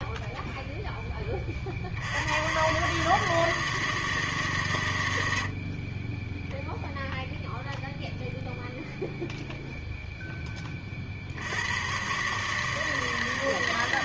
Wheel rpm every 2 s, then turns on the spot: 0, 80, 160, 20, 0, 0, 130.
none